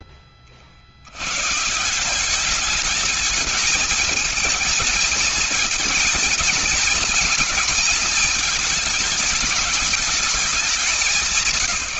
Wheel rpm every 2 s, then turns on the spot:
60, 210, 220, 220, 220, 190.
none